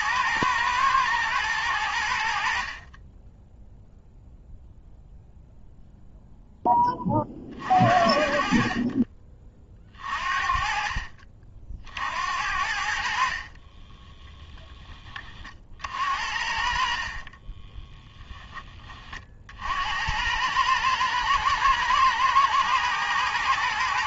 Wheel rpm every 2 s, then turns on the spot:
110, 30, 0, 20, 40, 40, 60, 10, 50, 30, 110, 110.
none